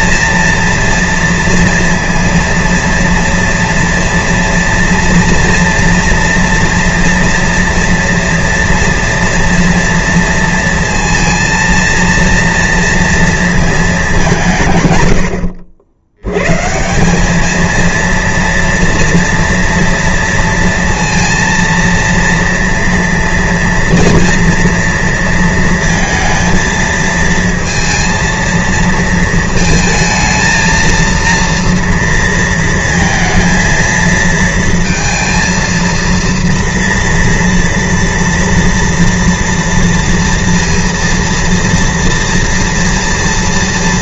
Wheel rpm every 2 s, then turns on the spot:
230, 230, 230, 230, 230, 230, 230, 130, 140, 230, 230, 230, 230, 230, 230, 230, 230, 230, 230, 230, 230, 230.
none